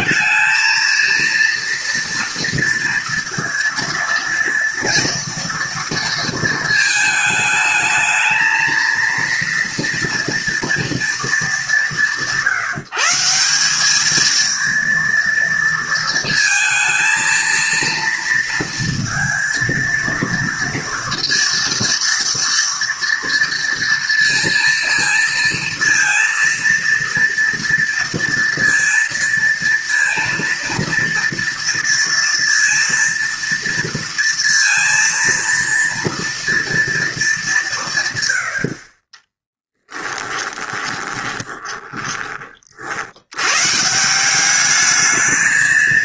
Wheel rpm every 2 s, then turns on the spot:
220, 230, 230, 220, 230, 230, 170, 230, 230, 230, 230, 230, 230, 230, 230, 230, 230, 230, 230, 70, 20, 40, 200.
40-42